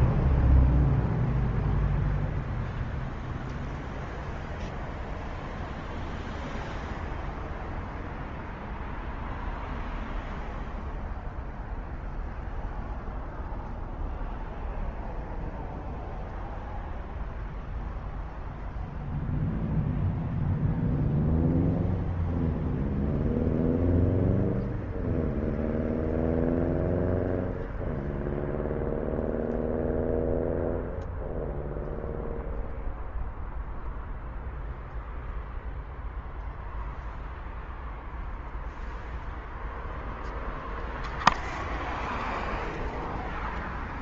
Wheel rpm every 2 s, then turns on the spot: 0, 0, 0, 0, 0, 0, 0, 0, 0, 0, 0, 0, 0, 0, 0, 0, 0, 0, 0, 0, 0, 0.
none